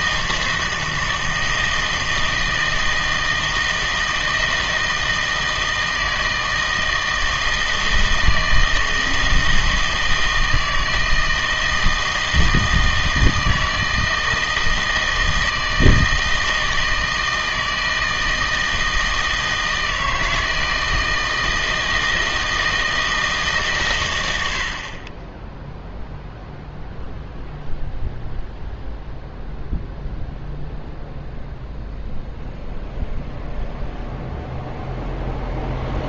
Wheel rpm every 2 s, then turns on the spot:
160, 160, 160, 160, 160, 160, 160, 160, 160, 160, 160, 160, 60, 0, 0, 0, 0, 0.
none